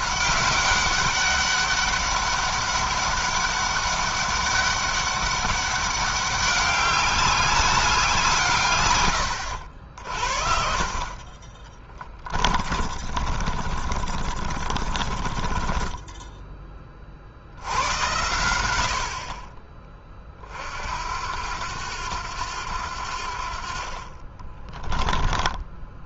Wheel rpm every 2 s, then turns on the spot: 200, 200, 200, 200, 140, 50, 40, 40, 30, 60, 60, 80, 20.
10-16 24-26